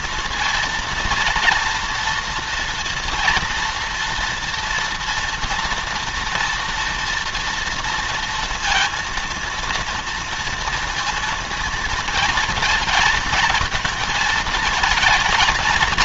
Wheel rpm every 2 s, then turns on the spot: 230, 240, 230, 230, 230, 230, 220, 230.
none